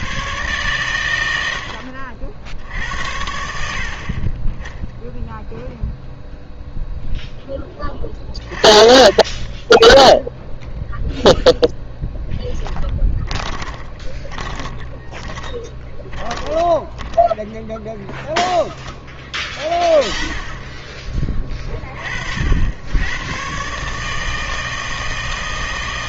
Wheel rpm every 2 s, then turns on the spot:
120, 60, 20, 0, 30, 0, 10, 30, 10, 0, 10, 70, 160.
12-18